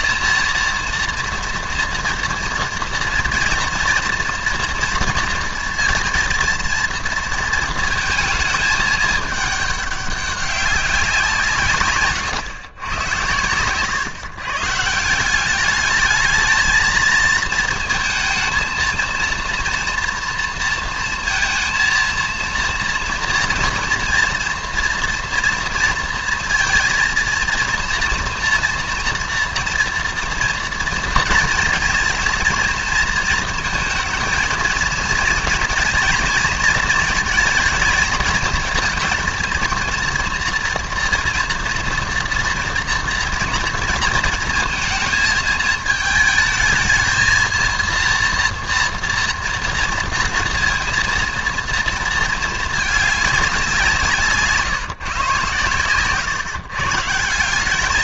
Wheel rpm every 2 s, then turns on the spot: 240, 230, 230, 230, 210, 200, 110, 150, 220, 230, 230, 230, 230, 230, 230, 230, 230, 230, 230, 230, 230, 240, 230, 220, 230, 230, 220, 150, 130.
none